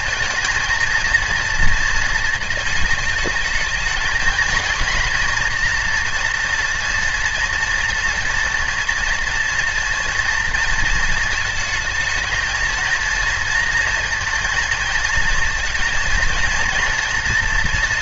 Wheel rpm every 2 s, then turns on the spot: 230, 220, 230, 240, 230, 230, 230, 230, 230.
none